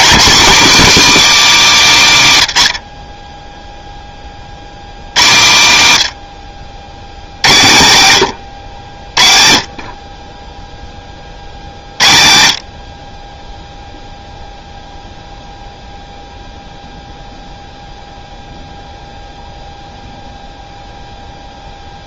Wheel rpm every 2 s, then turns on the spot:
250, 110, 60, 80, 90, 10, 70, 0, 0, 0, 0.
none